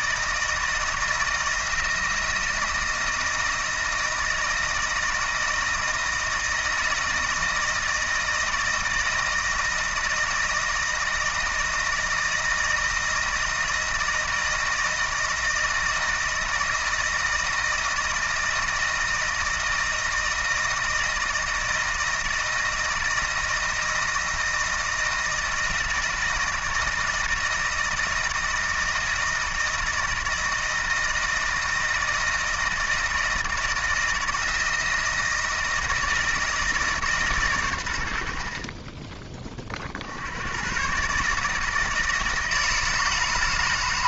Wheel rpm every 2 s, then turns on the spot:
160, 160, 160, 160, 160, 160, 160, 160, 160, 160, 160, 160, 160, 160, 160, 160, 160, 160, 160, 20, 130, 160.
none